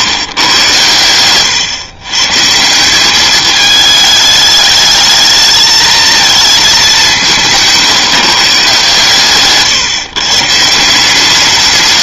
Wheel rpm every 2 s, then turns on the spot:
120, 170, 210, 220, 150, 170.
none